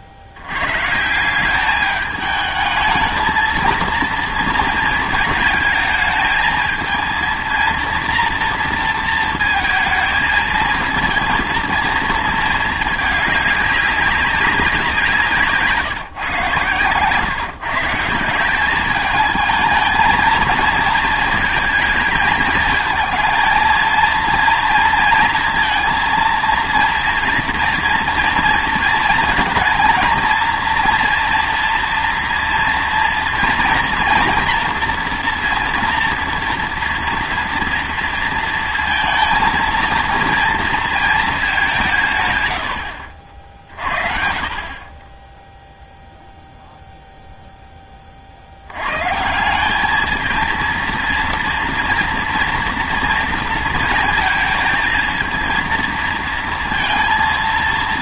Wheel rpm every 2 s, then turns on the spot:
70, 210, 220, 220, 230, 220, 210, 180, 130, 200, 220, 220, 230, 230, 230, 230, 230, 230, 230, 230, 230, 100, 40, 0, 80, 230, 230, 220, 230.
none